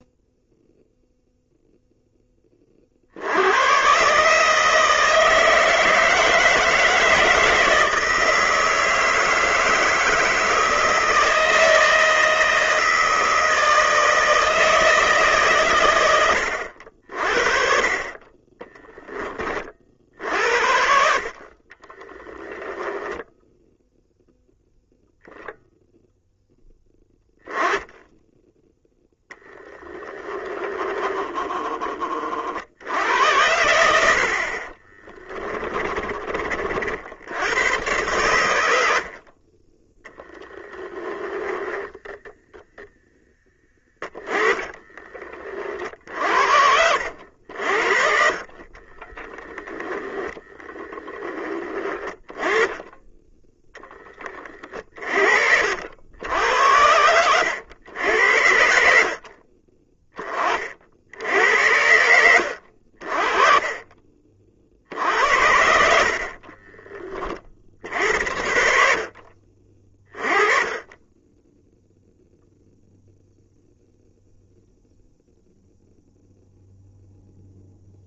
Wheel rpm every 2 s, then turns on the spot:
0, 40, 160, 160, 160, 160, 160, 160, 70, 10, 60, 10, 0, 10, 10, 20, 70, 40, 60, 70, 10, 0, 20, 60, 40, 10, 20, 50, 80, 60, 50, 50, 50, 50, 60, 20, 0, 0, 0.
30-32 34-36 38-42 44-50 52-56 58-60